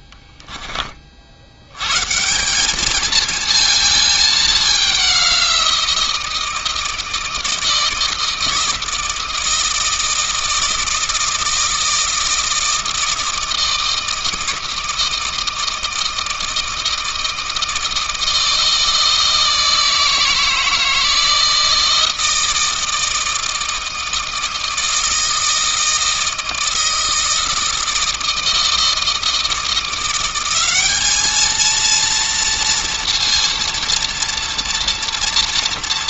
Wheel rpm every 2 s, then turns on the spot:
20, 200, 200, 160, 160, 160, 160, 160, 160, 160, 160, 160, 160, 160, 160, 200, 230, 230.
none